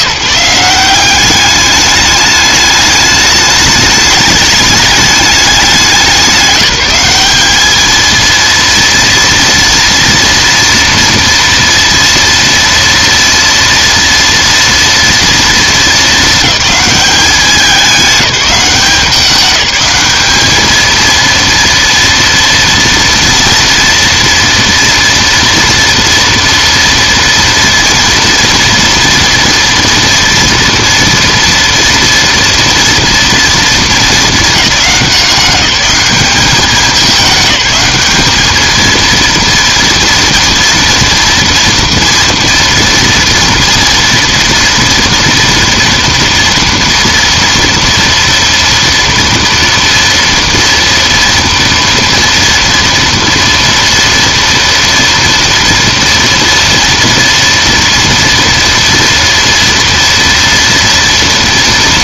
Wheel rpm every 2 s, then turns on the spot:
180, 210, 220, 190, 230, 230, 230, 230, 210, 190, 220, 230, 230, 230, 240, 230, 240, 200, 190, 220, 230, 230, 230, 230, 230, 230, 230, 230, 230, 230, 230.
none